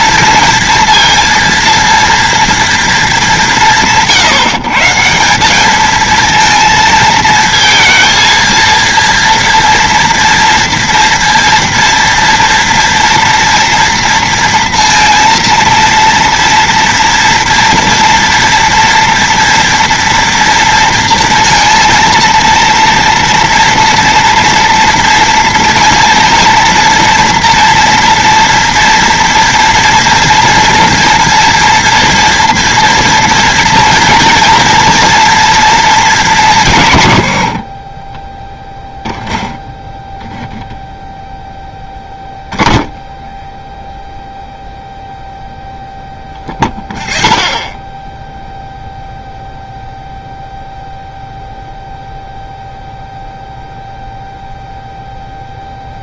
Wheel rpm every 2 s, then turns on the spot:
230, 230, 160, 230, 230, 230, 240, 230, 230, 230, 230, 230, 230, 240, 230, 230, 230, 240, 160, 10, 0, 10, 0, 30, 0, 0, 0, 0.
none